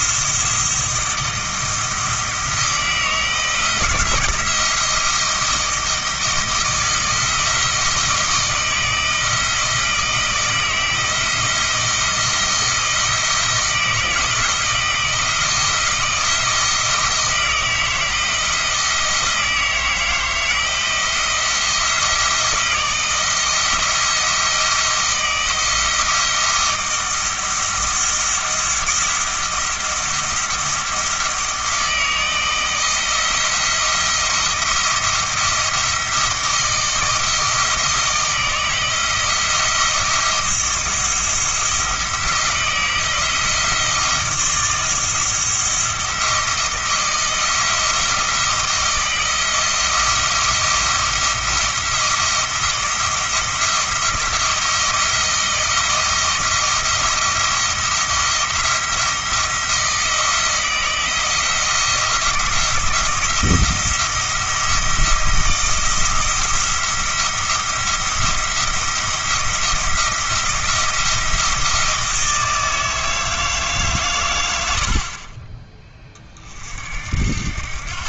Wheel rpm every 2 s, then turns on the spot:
170, 160, 170, 160, 160, 160, 160, 170, 160, 160, 160, 160, 170, 170, 170, 160, 160, 170, 160, 160, 170, 160, 160, 170, 160, 170, 170, 170, 170, 170, 170, 170, 170, 170, 170, 170, 160, 60, 60.
none